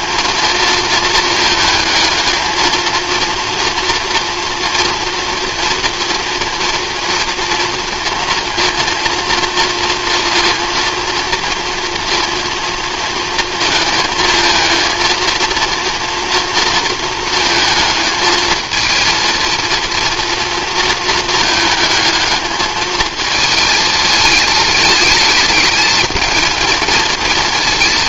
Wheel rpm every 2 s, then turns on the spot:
220, 230, 230, 230, 230, 230, 230, 230, 230, 220, 230, 220, 210, 230.
none